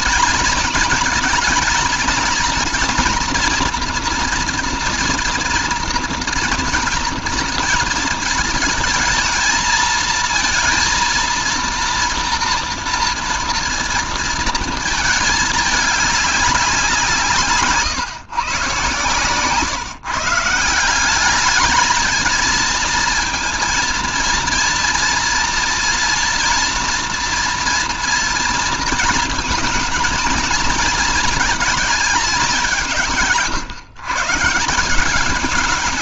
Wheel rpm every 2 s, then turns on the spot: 220, 230, 230, 230, 220, 230, 230, 220, 170, 130, 190, 230, 230, 230, 230, 230, 160, 180.
none